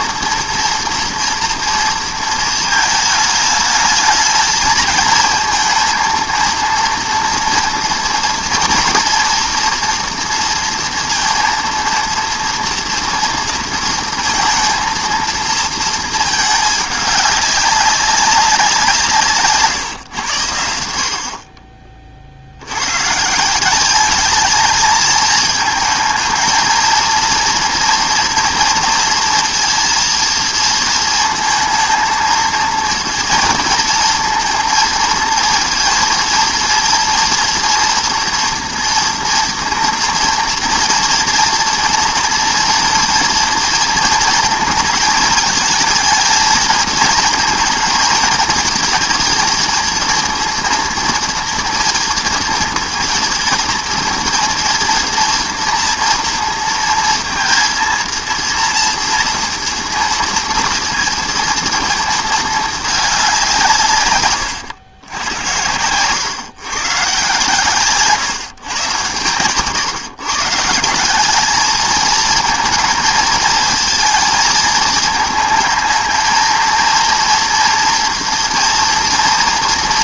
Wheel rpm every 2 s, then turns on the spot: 230, 230, 220, 230, 230, 240, 230, 230, 220, 190, 110, 60, 210, 220, 230, 230, 230, 230, 230, 230, 230, 230, 230, 230, 220, 230, 230, 230, 230, 230, 230, 220, 120, 110, 150, 140, 220, 230, 220, 230.
64-66